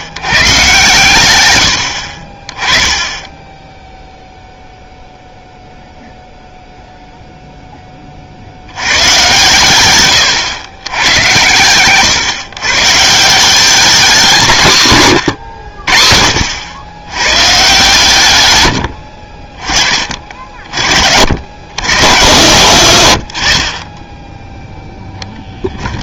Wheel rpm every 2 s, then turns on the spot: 110, 10, 0, 0, 110, 110, 150, 140, 110, 40, 60, 100, 10.
18-20